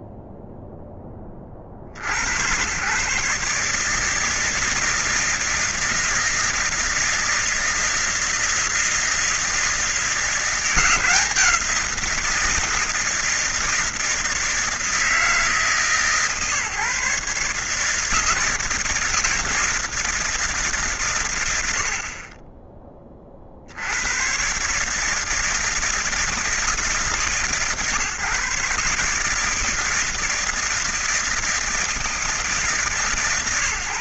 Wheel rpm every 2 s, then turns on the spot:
0, 120, 160, 160, 160, 170, 170, 160, 140, 160, 160, 20, 130, 160, 150, 160, 160.
none